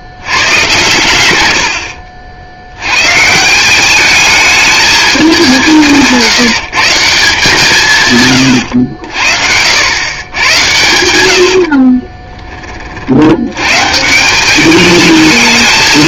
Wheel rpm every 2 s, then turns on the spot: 80, 190, 180, 150, 90, 60, 110, 220.
10-12